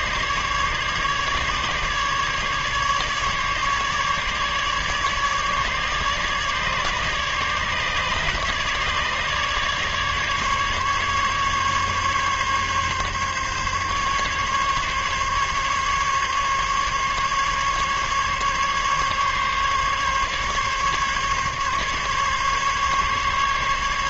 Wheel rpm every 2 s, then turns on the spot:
150, 150, 150, 150, 150, 140, 140, 140, 140, 140, 140, 140.
none